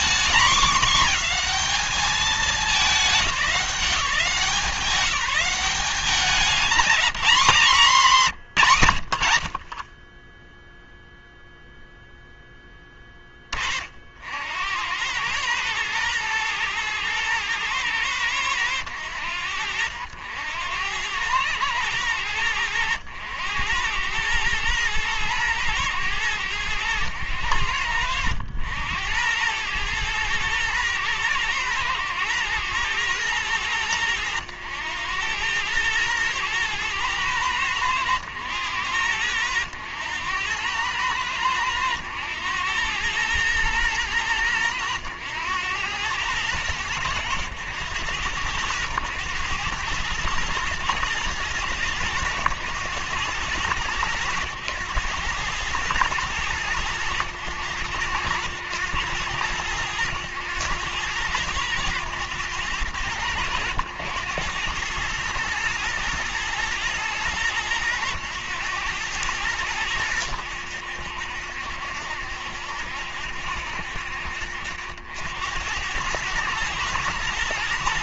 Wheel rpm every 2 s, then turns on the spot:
230, 200, 180, 200, 100, 0, 10, 90, 110, 90, 90, 90, 110, 100, 90, 110, 110, 100, 110, 100, 100, 110, 90, 100, 100, 110, 110, 100, 100, 90, 100, 100, 110, 110, 100, 70, 70, 70, 110.
none